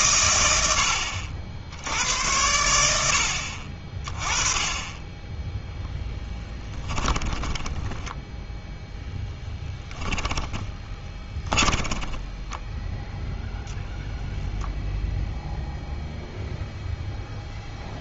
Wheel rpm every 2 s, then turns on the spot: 90, 90, 20, 10, 0, 20, 10, 10, 0.
6-8 10-14